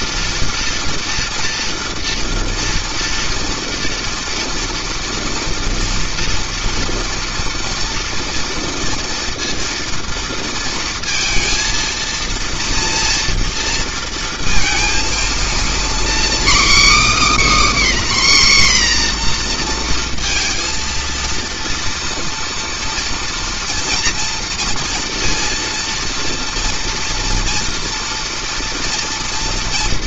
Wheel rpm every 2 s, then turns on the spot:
230, 230, 230, 230, 230, 230, 230, 230, 290, 260, 230, 230, 230, 230, 230.
none